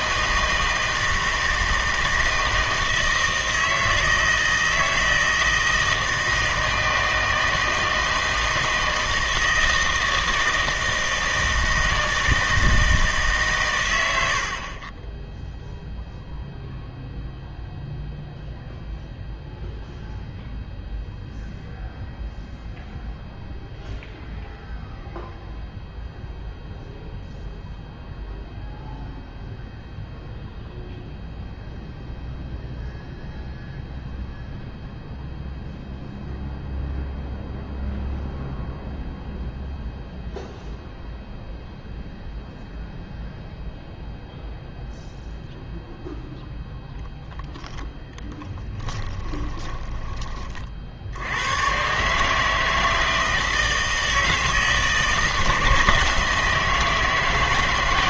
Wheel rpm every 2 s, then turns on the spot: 160, 160, 160, 160, 160, 160, 160, 60, 0, 0, 0, 0, 0, 0, 0, 0, 0, 0, 0, 0, 0, 0, 0, 0, 20, 40, 160, 160, 160.
48-50